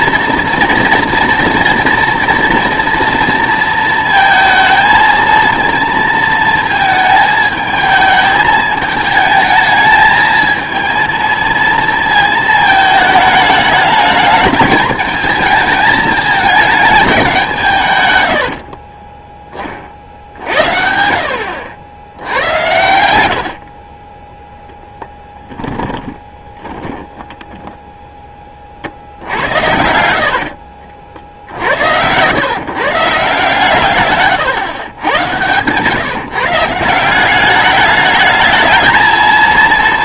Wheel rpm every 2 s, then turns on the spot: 230, 230, 220, 220, 220, 220, 220, 220, 220, 60, 50, 90, 0, 20, 50, 70, 140, 110, 150, 220.
18-20 26-28 30-32 34-36